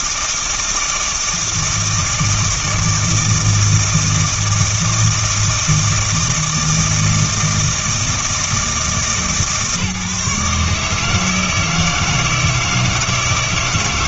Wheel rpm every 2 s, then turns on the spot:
160, 160, 160, 160, 160, 150, 160.
none